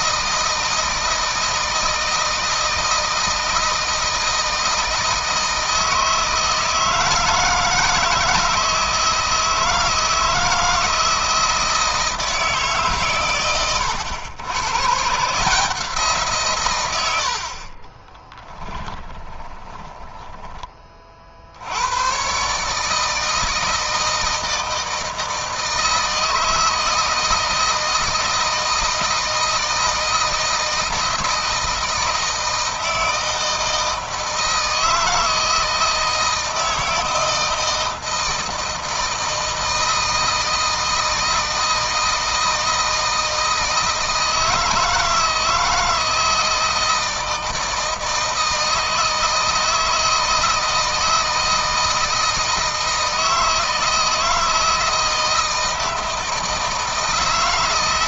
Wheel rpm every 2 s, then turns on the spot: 160, 160, 160, 160, 160, 160, 150, 120, 120, 10, 20, 140, 160, 160, 160, 160, 160, 160, 160, 160, 160, 160, 160, 160, 160, 160, 160, 160, 160.
18-20